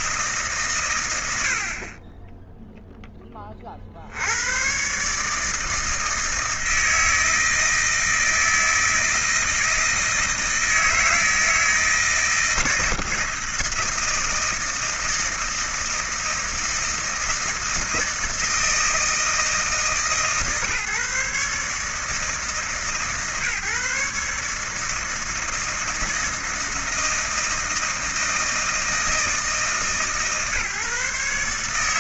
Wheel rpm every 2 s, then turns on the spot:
130, 0, 120, 160, 160, 160, 160, 160, 160, 160, 150, 150, 150, 160, 160, 140.
none